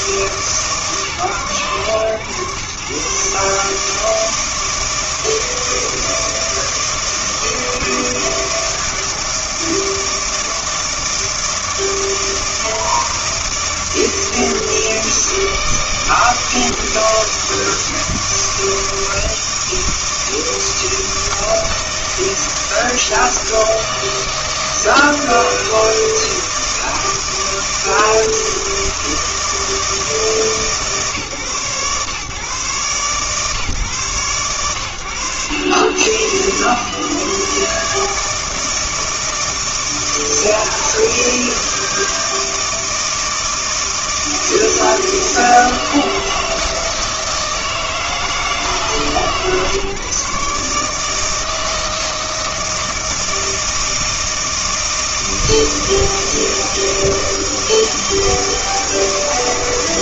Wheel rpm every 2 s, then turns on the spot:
150, 130, 160, 160, 160, 160, 160, 160, 160, 160, 160, 160, 160, 160, 160, 150, 130, 100, 120, 160, 160, 160, 160, 160, 150, 140, 160, 160, 160, 160.
none